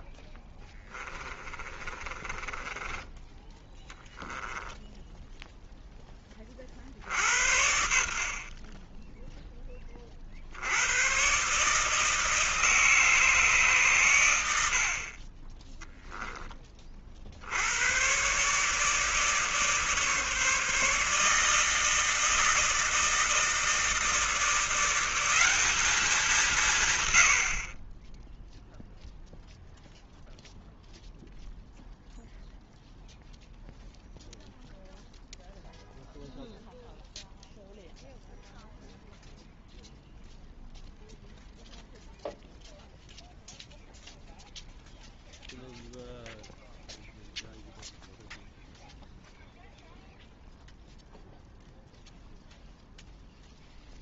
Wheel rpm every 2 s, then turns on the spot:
20, 20, 10, 50, 30, 80, 150, 70, 30, 150, 150, 160, 170, 140, 0, 0, 0, 0, 0, 0, 0, 0, 0, 0, 0, 0, 0.
0-6